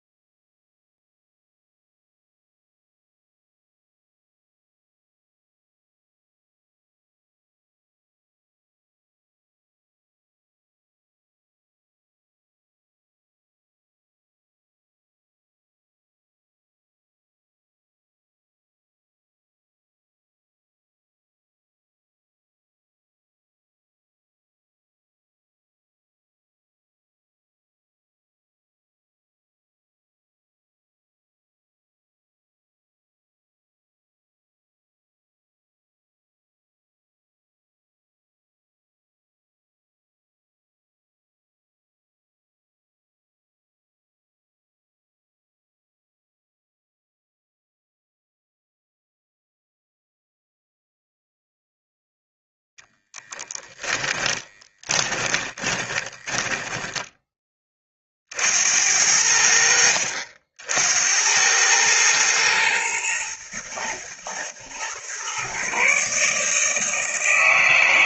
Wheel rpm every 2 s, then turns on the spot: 0, 0, 0, 0, 0, 0, 0, 0, 0, 0, 0, 0, 0, 0, 0, 0, 0, 0, 0, 0, 0, 0, 0, 0, 0, 0, 10, 30, 10, 80, 70, 110, 120, 160.
52-58